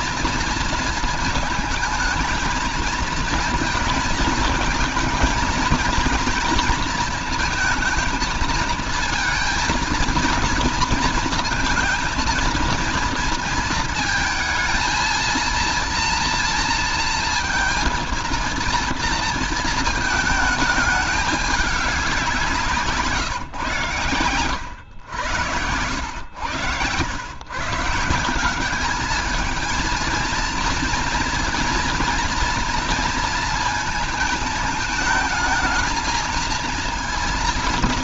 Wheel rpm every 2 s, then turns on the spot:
230, 220, 220, 220, 230, 230, 230, 220, 230, 230, 210, 170, 100, 110, 190, 230, 230, 220, 230.
none